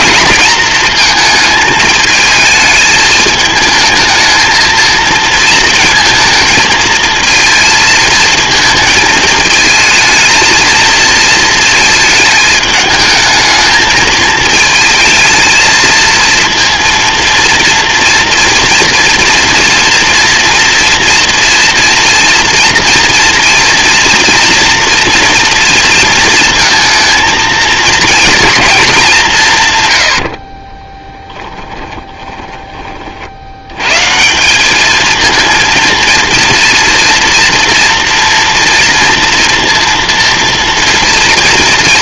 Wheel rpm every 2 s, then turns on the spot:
220, 210, 230, 230, 220, 230, 210, 220, 230, 230, 230, 230, 230, 230, 190, 10, 40, 220, 230, 230, 230.
30-32